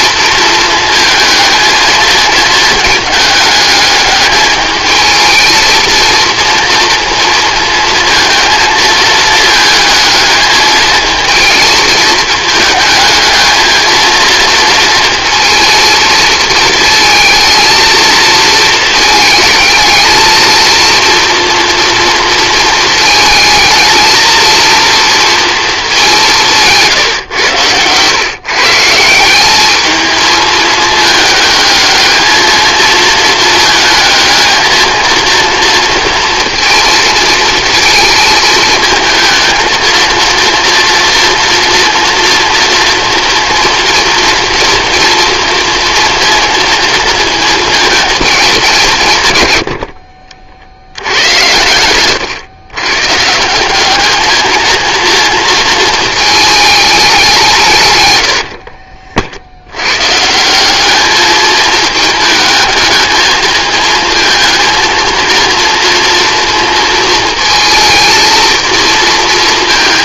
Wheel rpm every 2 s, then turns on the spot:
230, 220, 220, 230, 220, 220, 220, 230, 230, 230, 230, 230, 230, 170, 140, 220, 230, 220, 230, 220, 230, 230, 230, 230, 190, 60, 110, 230, 220, 60, 180, 220, 220, 230, 220.
26-28 58-60